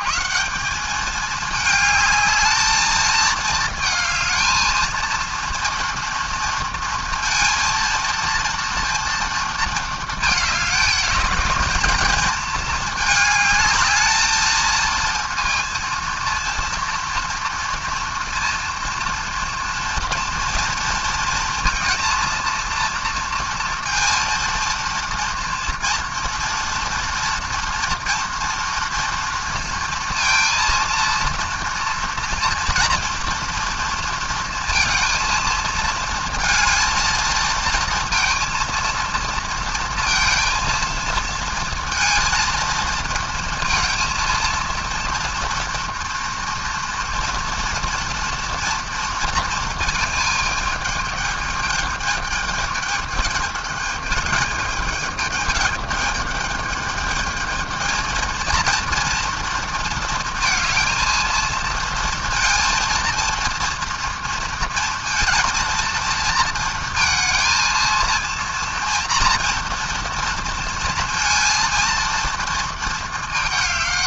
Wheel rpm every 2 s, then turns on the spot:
220, 220, 230, 230, 230, 210, 220, 230, 230, 230, 230, 230, 230, 230, 230, 230, 230, 230, 230, 230, 230, 230, 230, 230, 230, 210, 210, 210, 220, 230, 220, 230, 230, 230, 230, 230, 220.
none